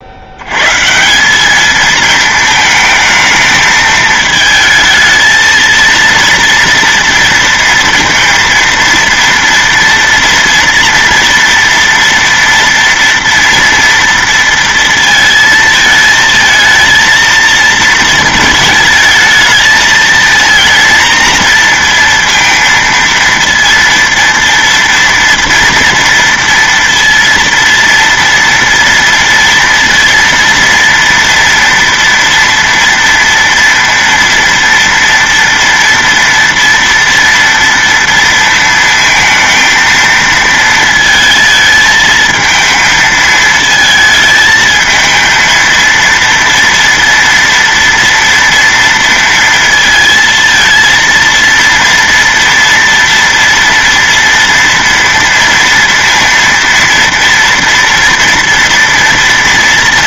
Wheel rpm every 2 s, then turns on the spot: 110, 220, 220, 230, 230, 230, 230, 230, 220, 220, 230, 230, 230, 230, 230, 230, 230, 230, 230, 230, 230, 220, 220, 230, 230, 230, 230, 230, 230, 230.
none